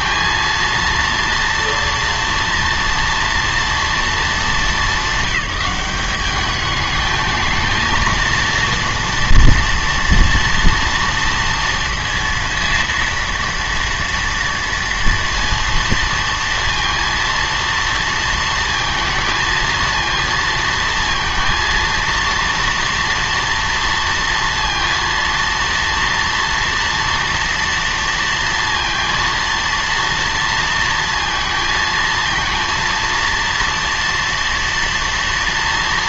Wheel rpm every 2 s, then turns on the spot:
230, 230, 210, 210, 230, 230, 230, 230, 230, 230, 230, 230, 230, 230, 230, 230, 230, 230.
none